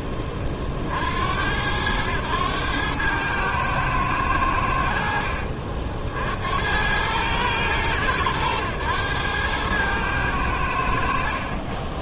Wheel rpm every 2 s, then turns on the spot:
50, 110, 80, 80, 100, 80.
none